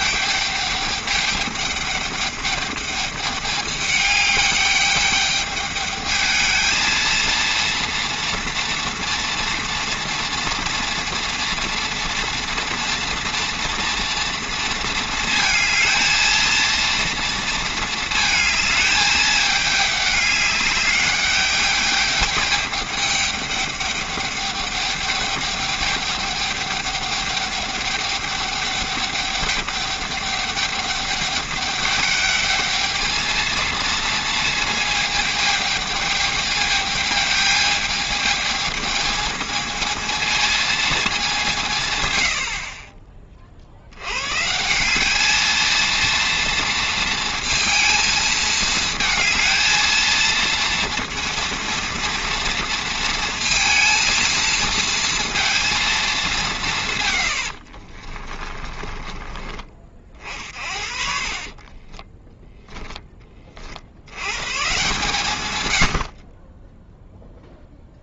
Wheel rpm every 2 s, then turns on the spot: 210, 210, 210, 220, 230, 240, 230, 230, 230, 220, 200, 210, 200, 200, 200, 210, 220, 220, 210, 220, 230, 40, 170, 230, 220, 230, 230, 230, 170, 30, 50, 10, 130, 10.
58-60 62-64